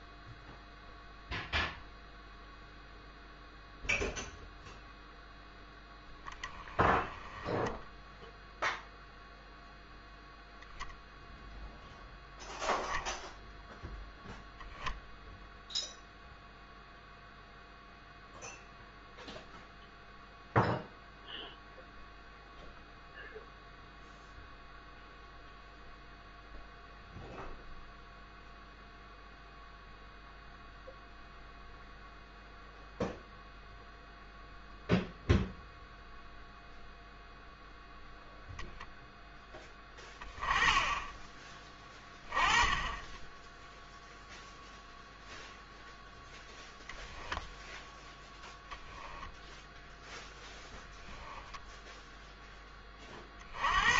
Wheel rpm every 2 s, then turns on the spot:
0, 0, 0, 10, 0, 0, 0, 0, 0, 0, 0, 0, 0, 0, 0, 0, 0, 0, 0, 10, 20, 10, 0, 10, 0, 0, 10.
none